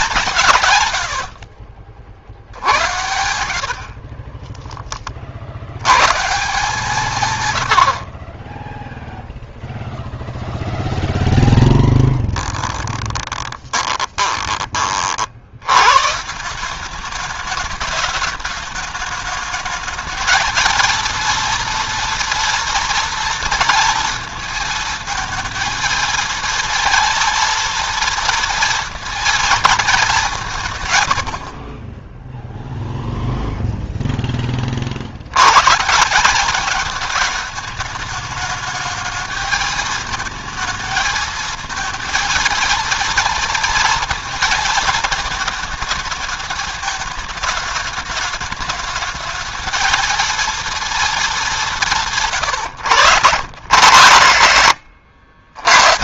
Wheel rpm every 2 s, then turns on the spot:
120, 70, 20, 150, 0, 0, 10, 40, 190, 210, 230, 230, 220, 230, 230, 130, 0, 50, 210, 220, 220, 230, 220, 220, 210, 230, 120, 100.
12-14